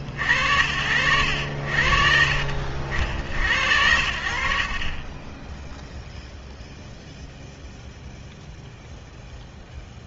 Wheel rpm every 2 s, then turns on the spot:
40, 70, 90, 0, 0.
none